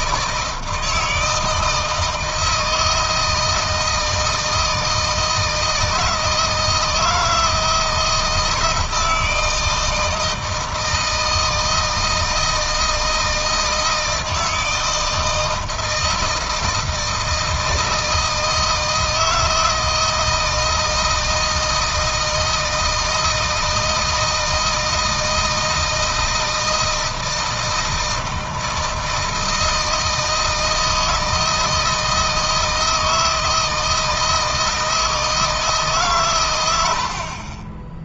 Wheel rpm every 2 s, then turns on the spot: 160, 160, 160, 160, 160, 160, 160, 160, 160, 160, 160, 160, 160, 160, 160, 160, 160, 160, 90.
none